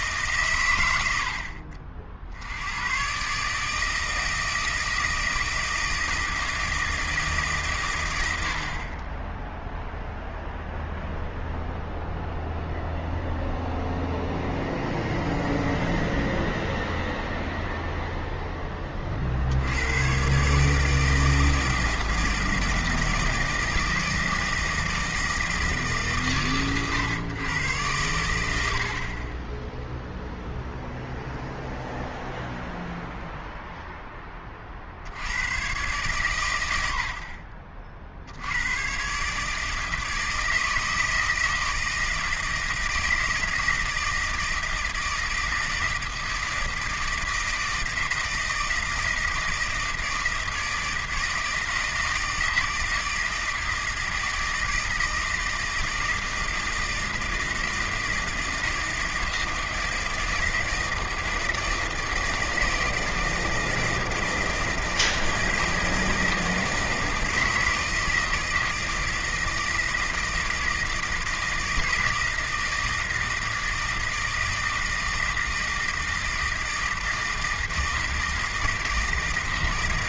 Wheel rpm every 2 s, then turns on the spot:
110, 100, 160, 160, 60, 0, 0, 0, 0, 10, 150, 160, 160, 110, 60, 0, 0, 50, 100, 110, 160, 160, 160, 160, 160, 160, 160, 160, 160, 160, 160, 160, 160, 160, 160, 160, 160, 160, 160, 160.
none